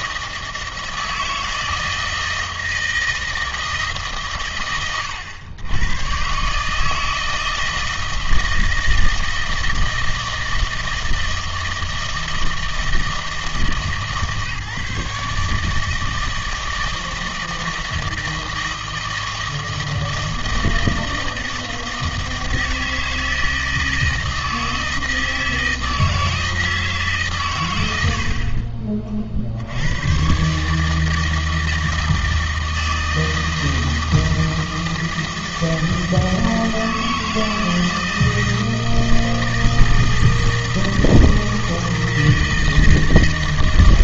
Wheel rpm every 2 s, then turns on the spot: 160, 160, 120, 150, 160, 160, 160, 150, 160, 160, 160, 160, 160, 160, 40, 140, 160, 160, 160, 160, 160, 160.
28-30